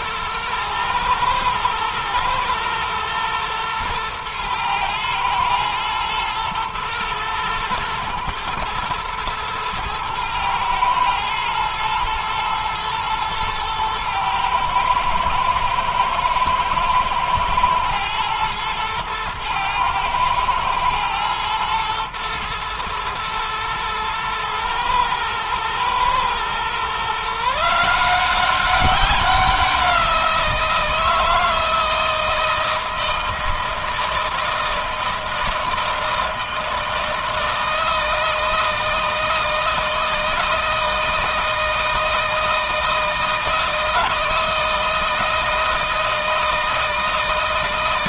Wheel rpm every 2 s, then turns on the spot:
120, 110, 110, 120, 110, 110, 120, 110, 110, 110, 110, 110, 110, 120, 190, 170, 160, 160, 160, 160, 160, 160, 160, 160.
none